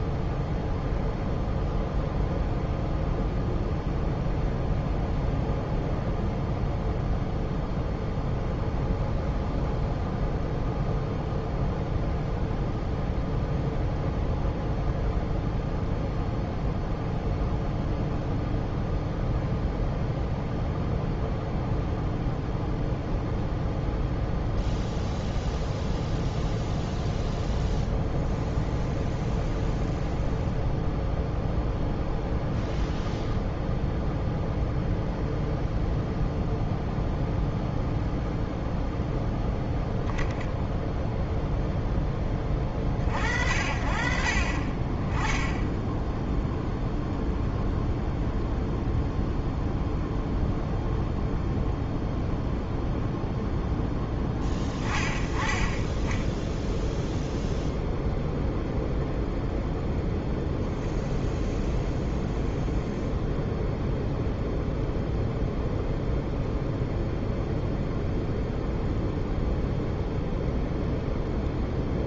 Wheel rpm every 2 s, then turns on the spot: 0, 0, 0, 0, 0, 0, 0, 0, 0, 0, 0, 0, 0, 0, 0, 0, 0, 0, 0, 0, 0, 20, 40, 0, 0, 0, 0, 10, 10, 0, 0, 0, 0, 0, 0, 0.
none